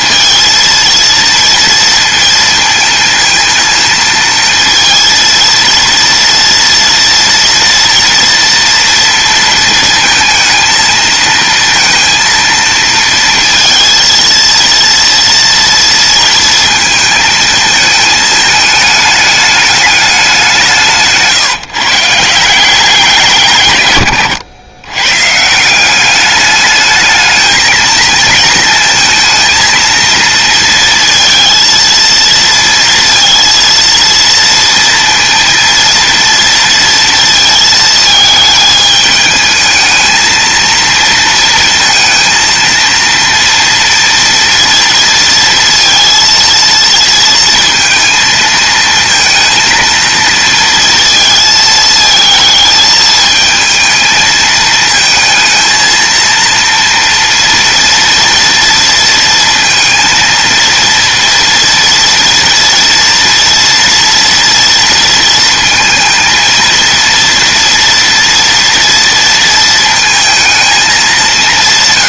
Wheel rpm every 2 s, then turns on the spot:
230, 230, 230, 240, 230, 230, 230, 230, 230, 210, 170, 180, 110, 210, 230, 230, 230, 230, 230, 220, 230, 230, 230, 230, 220, 230, 220, 220, 230, 230, 230, 230, 230, 230, 230, 220.
none